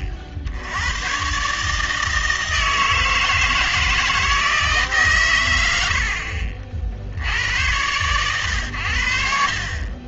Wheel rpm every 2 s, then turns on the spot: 70, 160, 160, 30, 110.
none